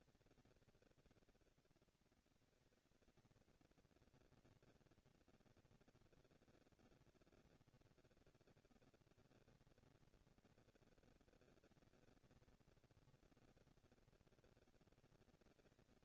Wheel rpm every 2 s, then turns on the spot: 240, 230, 230, 230, 230, 230, 230, 230.
none